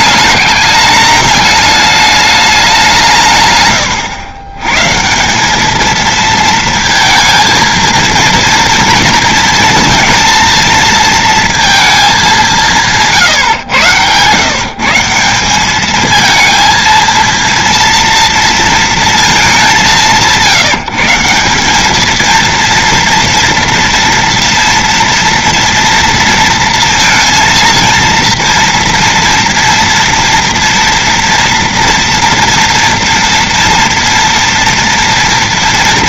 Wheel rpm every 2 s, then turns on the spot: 210, 210, 120, 230, 230, 230, 220, 130, 220, 230, 180, 220, 230, 230, 230, 230, 230, 230.
none